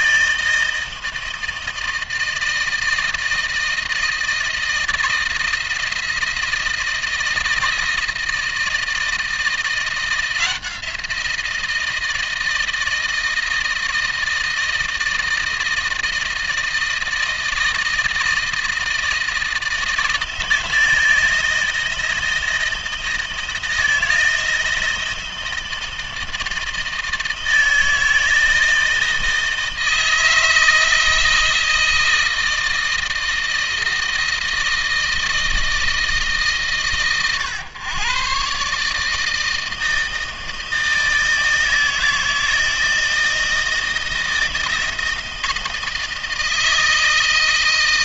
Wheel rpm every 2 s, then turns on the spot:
160, 160, 160, 170, 160, 170, 160, 160, 160, 160, 160, 160, 160, 160, 160, 160, 160, 160, 140, 140, 160, 160, 160, 160.
none